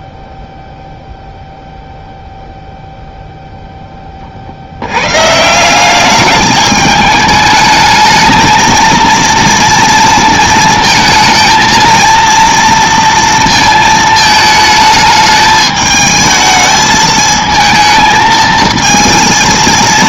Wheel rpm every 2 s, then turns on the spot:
0, 0, 70, 210, 220, 220, 230, 220, 220, 220.
none